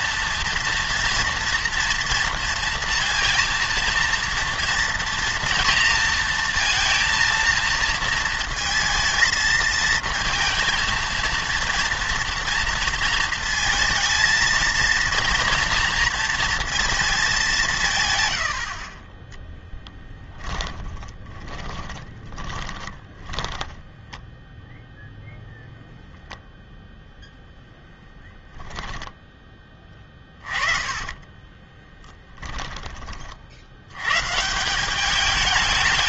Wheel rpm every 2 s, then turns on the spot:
240, 230, 230, 230, 230, 230, 230, 220, 230, 50, 20, 20, 10, 0, 20, 30, 20, 170.
18-24 28-34